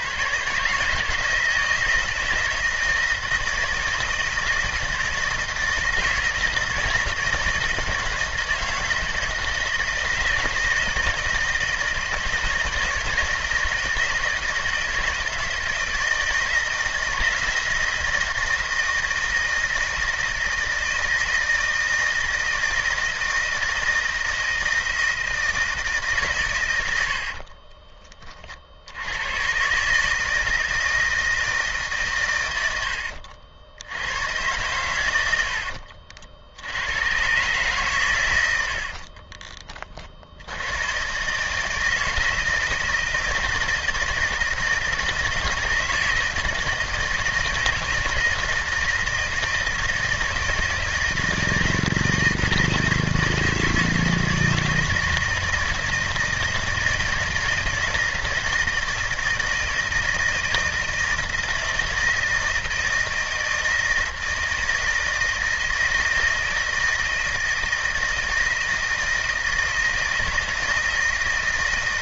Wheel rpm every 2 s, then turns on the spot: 140, 160, 160, 160, 160, 160, 160, 160, 160, 170, 160, 160, 160, 110, 50, 160, 100, 120, 80, 80, 90, 160, 160, 160, 160, 160, 160, 160, 160, 160, 160, 160, 160, 160, 160, 160.
none